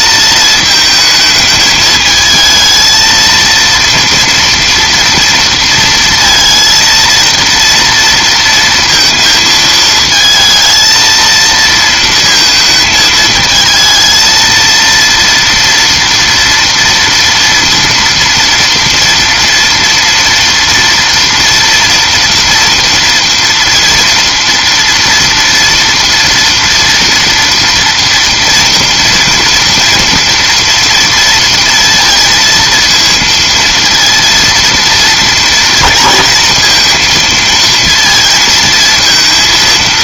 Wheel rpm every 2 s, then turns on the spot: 220, 220, 230, 230, 230, 230, 220, 230, 240, 230, 230, 230, 230, 230, 240, 230, 230, 230, 230, 220.
none